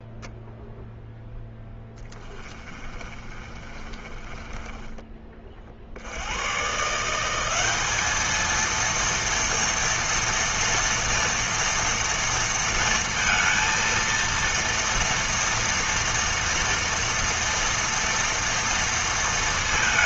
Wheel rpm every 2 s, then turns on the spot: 0, 30, 20, 160, 230, 230, 230, 230, 230, 230.
2-6